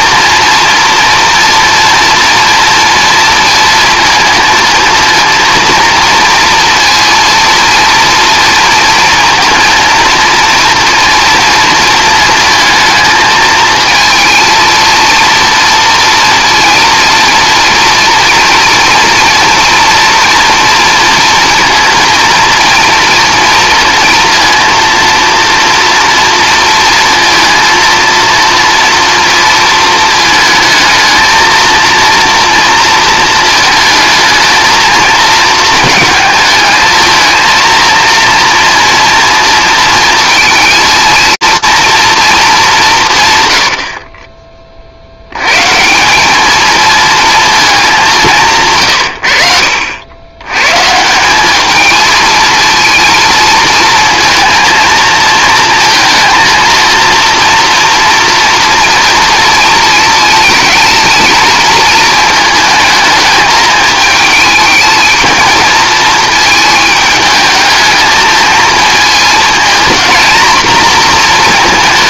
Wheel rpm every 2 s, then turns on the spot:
240, 240, 230, 230, 230, 230, 220, 230, 230, 230, 230, 230, 230, 230, 230, 220, 230, 220, 220, 230, 230, 190, 40, 230, 140, 140, 220, 230, 230, 230, 220, 220, 220, 220, 230, 240.
none